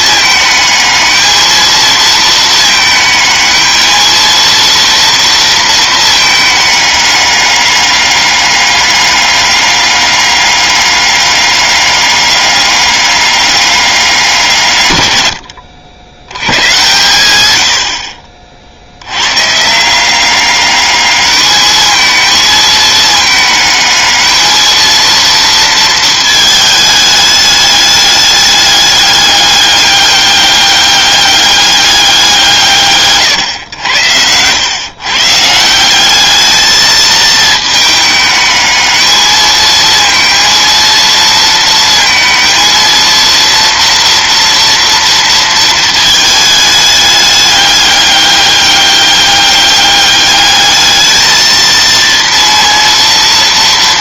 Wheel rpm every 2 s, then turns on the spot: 220, 220, 230, 210, 200, 200, 200, 140, 110, 60, 200, 220, 230, 220, 200, 200, 150, 110, 220, 220, 230, 230, 230, 210, 200, 210, 230.
none